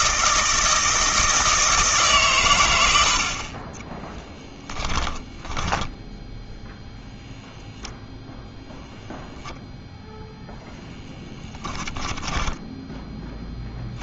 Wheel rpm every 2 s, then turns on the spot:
160, 120, 10, 0, 0, 0, 10.
4-6